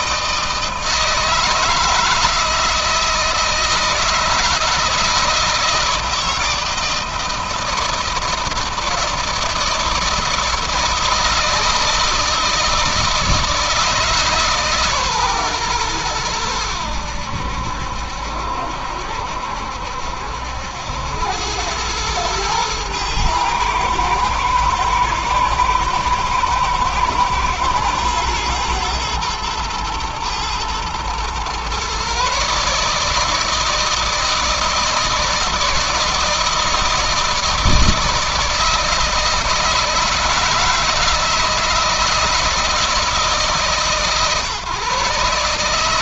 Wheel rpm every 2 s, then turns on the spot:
160, 160, 160, 160, 160, 160, 160, 150, 100, 70, 70, 110, 110, 110, 110, 110, 140, 160, 160, 160, 160, 160, 140.
none